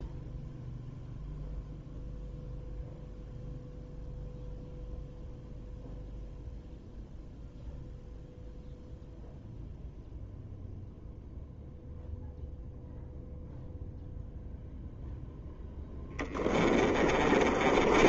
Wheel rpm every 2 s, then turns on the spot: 0, 0, 0, 0, 0, 0, 0, 0, 20.
16-18